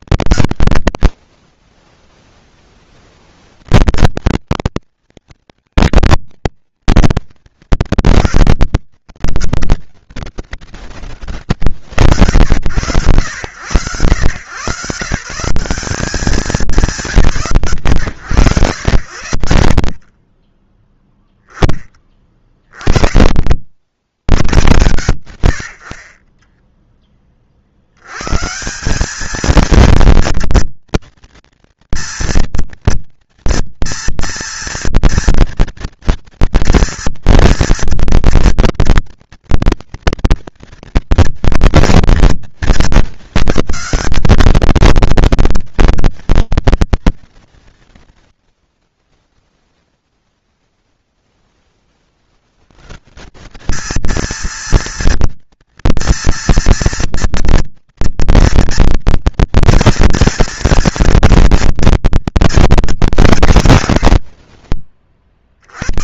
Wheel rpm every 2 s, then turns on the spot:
0, 150, 230, 160, 130, 100, 130, 190, 110, 20, 20, 90, 50, 80, 230, 240, 230, 240, 240, 230, 230, 200, 230, 60, 0, 40, 220, 230, 230, 230, 230, 140, 40.
none